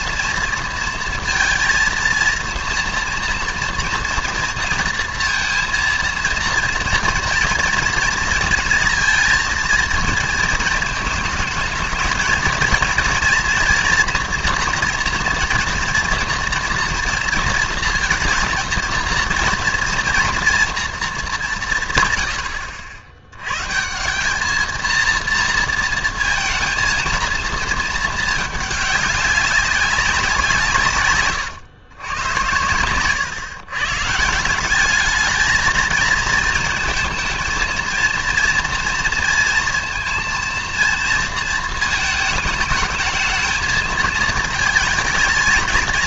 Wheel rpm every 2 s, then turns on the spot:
230, 230, 230, 230, 230, 220, 230, 240, 230, 230, 230, 90, 220, 230, 210, 160, 110, 190, 230, 230, 230, 220, 230.
none